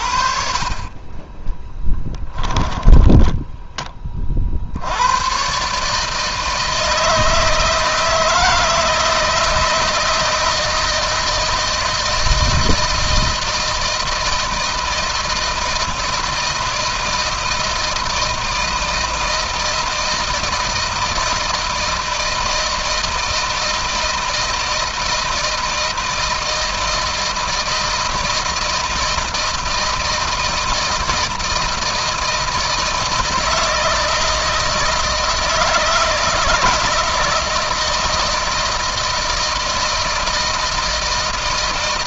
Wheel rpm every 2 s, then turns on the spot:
30, 10, 70, 160, 160, 160, 160, 160, 160, 160, 160, 160, 160, 160, 160, 160, 160, 160, 160, 160, 160.
2-4